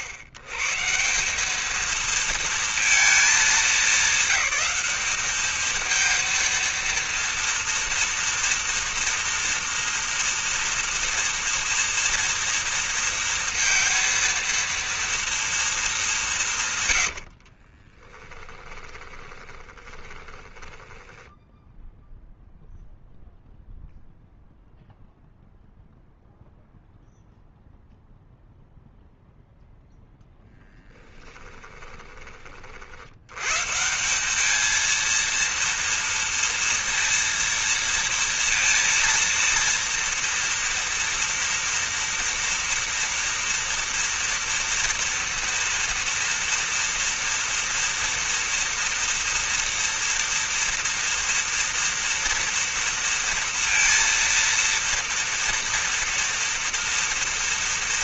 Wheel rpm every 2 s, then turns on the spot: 100, 230, 200, 230, 230, 240, 230, 230, 160, 20, 20, 0, 0, 0, 0, 0, 30, 200, 230, 230, 230, 230, 230, 240, 230, 230, 230, 230, 230.
18-22